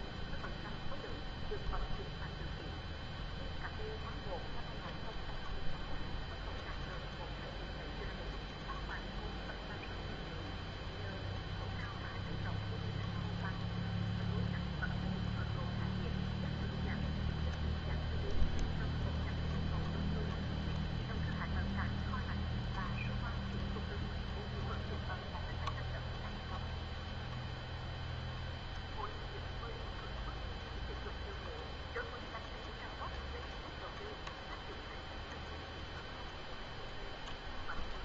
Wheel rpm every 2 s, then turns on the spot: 0, 0, 0, 0, 0, 0, 0, 0, 0, 0, 0, 0, 0, 0, 0, 0, 0, 0, 0.
none